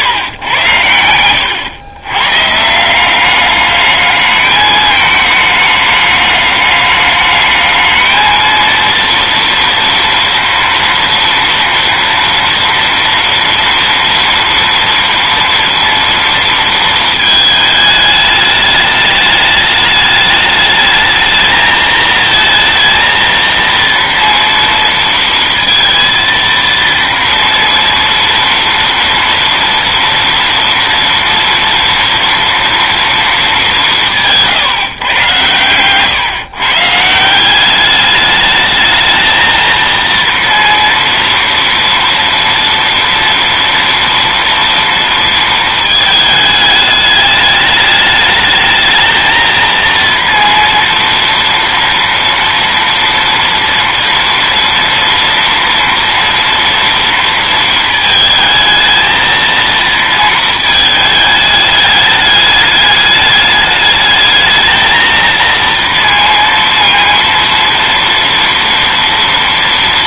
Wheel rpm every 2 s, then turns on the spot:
100, 160, 210, 210, 230, 240, 240, 230, 230, 210, 210, 230, 230, 230, 230, 230, 230, 150, 140, 210, 230, 230, 230, 210, 220, 230, 230, 230, 230, 220, 220, 210, 220, 230, 230.
none